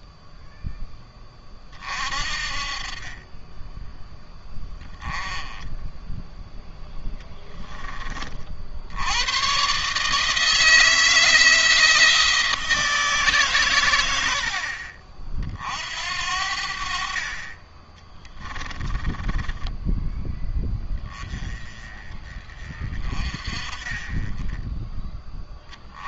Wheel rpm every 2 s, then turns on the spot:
10, 30, 30, 10, 70, 160, 160, 50, 50, 10, 20, 30, 10.
6-8 18-20